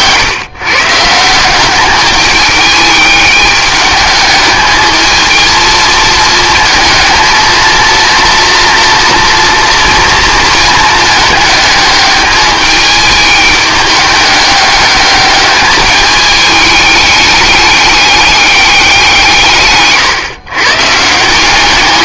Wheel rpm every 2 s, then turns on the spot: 140, 210, 210, 220, 230, 220, 210, 210, 210, 200, 140.
none